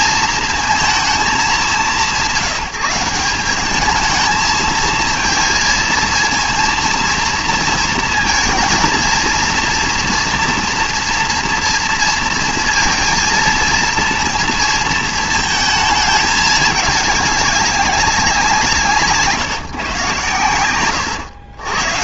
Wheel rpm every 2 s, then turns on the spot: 220, 180, 220, 230, 230, 230, 230, 230, 210, 160, 120.
none